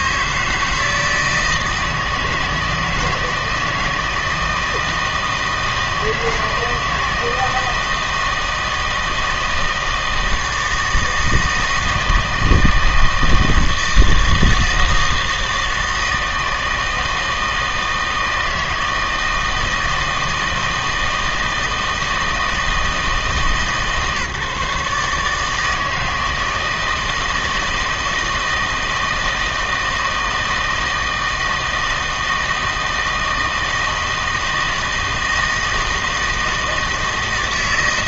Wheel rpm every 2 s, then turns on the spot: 150, 160, 160, 160, 160, 160, 160, 160, 160, 160, 160, 160, 150, 160, 160, 160, 160, 160, 160.
none